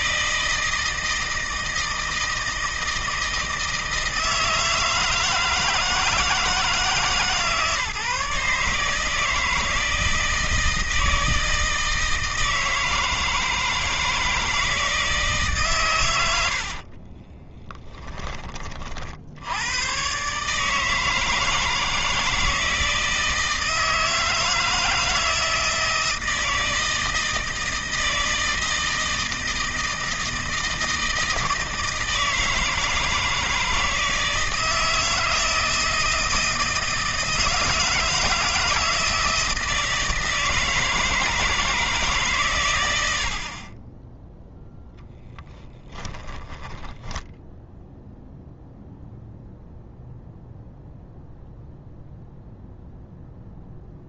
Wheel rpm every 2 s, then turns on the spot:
160, 160, 160, 160, 150, 160, 160, 160, 60, 40, 150, 160, 160, 160, 160, 160, 160, 160, 160, 160, 160, 110, 0, 20, 0, 0, 0.
16-18 46-48